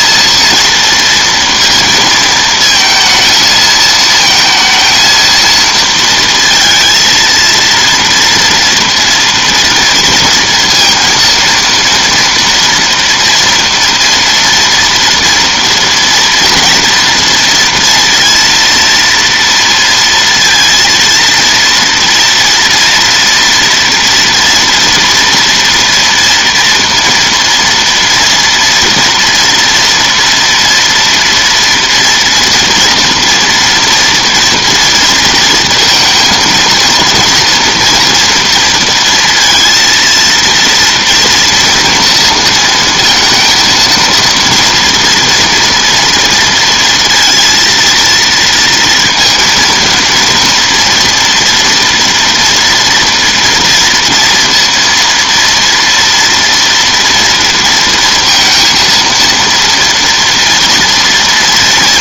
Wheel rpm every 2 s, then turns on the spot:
230, 230, 220, 230, 230, 230, 240, 230, 230, 230, 230, 230, 240, 230, 240, 230, 230, 230, 230, 230, 230, 230, 230, 230, 230, 230, 230, 230, 230, 230, 230.
none